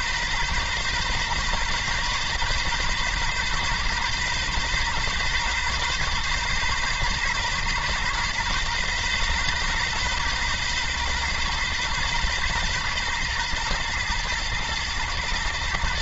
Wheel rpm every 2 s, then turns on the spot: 130, 130, 130, 130, 130, 130, 130, 110.
none